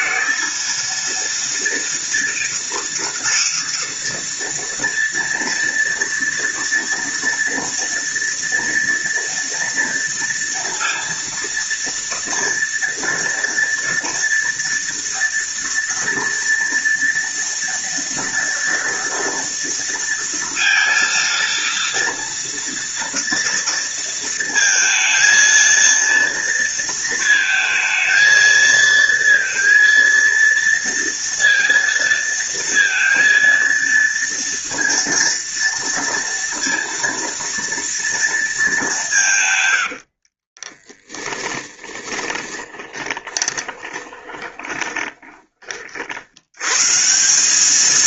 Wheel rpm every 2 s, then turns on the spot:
230, 230, 230, 230, 230, 230, 230, 230, 230, 230, 230, 230, 230, 230, 230, 230, 230, 230, 230, 150, 30, 20, 20, 180.
40-44